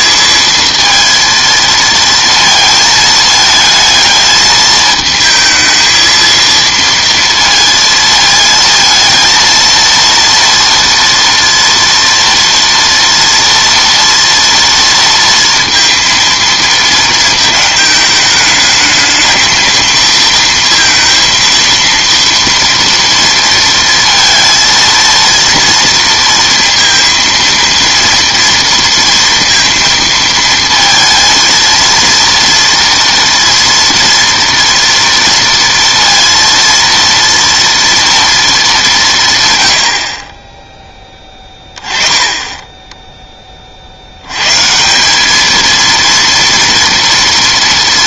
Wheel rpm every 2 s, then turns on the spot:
230, 220, 220, 230, 220, 230, 230, 230, 230, 210, 230, 230, 230, 230, 230, 230, 230, 230, 230, 200, 10, 10, 140, 230.
none